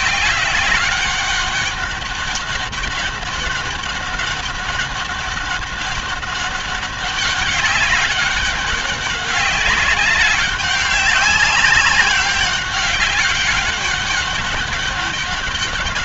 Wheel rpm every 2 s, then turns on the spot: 190, 200, 200, 200, 200, 200, 200, 200.
none